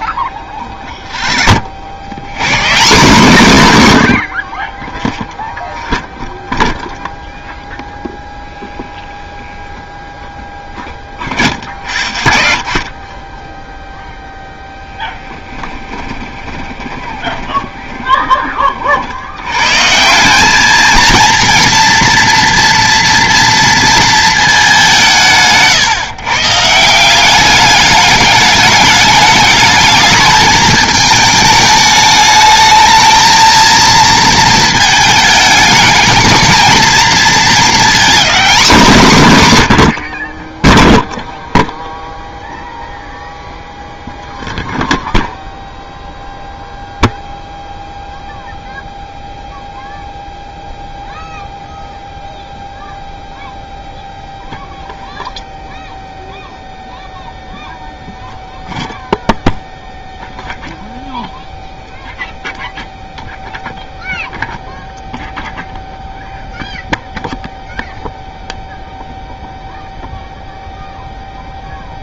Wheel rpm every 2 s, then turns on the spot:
10, 130, 30, 0, 0, 10, 60, 0, 20, 20, 200, 230, 210, 140, 210, 220, 210, 220, 220, 230, 10, 0, 0, 0, 0, 0, 0, 0, 0, 0, 0, 0, 0, 0, 0, 0.
16-18